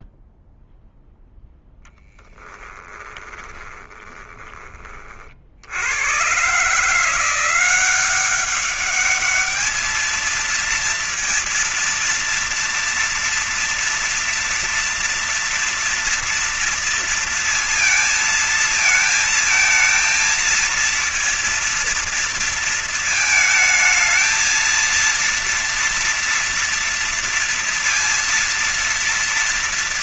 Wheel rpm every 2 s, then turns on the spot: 0, 10, 20, 120, 190, 220, 230, 230, 230, 230, 230, 230, 220, 230, 230.
2-4